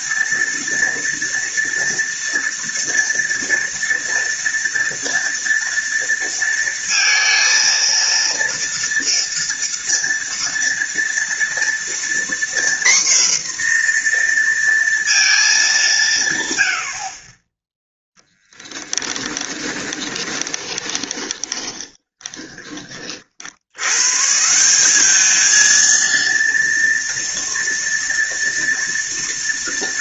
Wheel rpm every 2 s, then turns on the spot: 230, 230, 230, 230, 230, 230, 250, 230, 90, 10, 20, 30, 190, 230, 230.
16-22